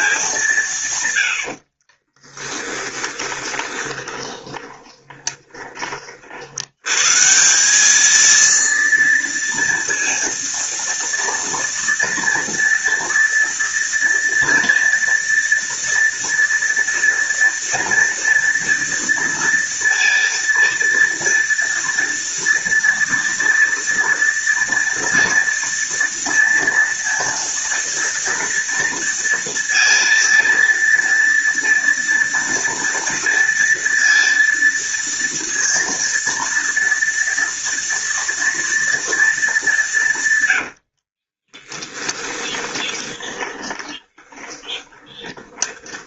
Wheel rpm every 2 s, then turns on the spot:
140, 10, 20, 100, 230, 230, 230, 230, 230, 230, 230, 230, 230, 230, 230, 230, 230, 230, 230, 230, 70, 20, 20.
2-6 40-46